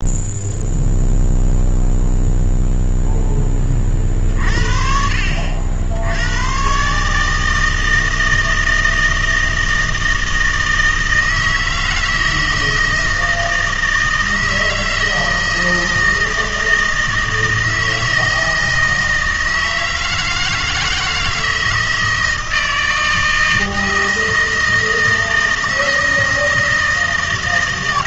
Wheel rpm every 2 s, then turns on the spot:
0, 0, 50, 130, 160, 160, 160, 160, 160, 160, 160, 160, 160, 160.
none